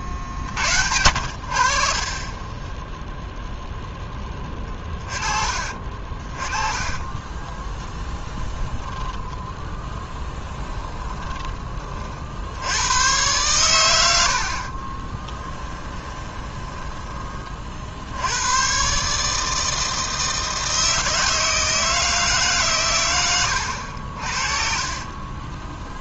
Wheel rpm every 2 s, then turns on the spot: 60, 10, 30, 20, 10, 10, 90, 40, 20, 120, 160, 130, 40.
10-12 14-18 24-26